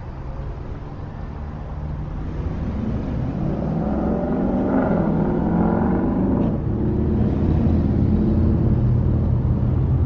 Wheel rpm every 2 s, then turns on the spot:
0, 0, 0, 0, 0.
none